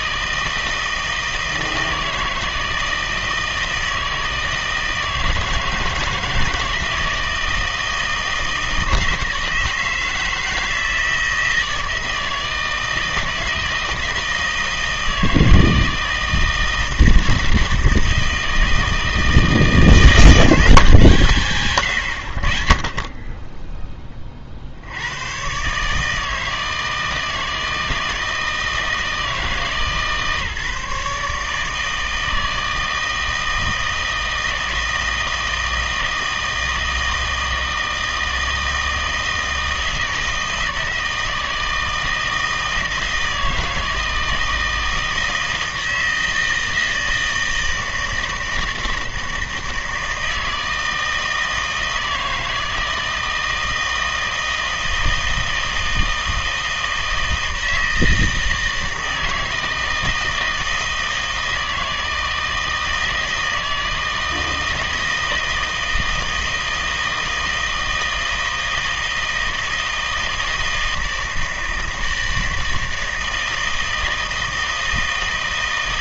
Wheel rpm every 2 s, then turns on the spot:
160, 160, 160, 160, 160, 160, 160, 160, 160, 160, 180, 40, 60, 160, 160, 150, 160, 160, 160, 160, 160, 160, 160, 160, 160, 160, 160, 160, 160, 160, 160, 160, 160, 160, 160, 160, 160, 160.
none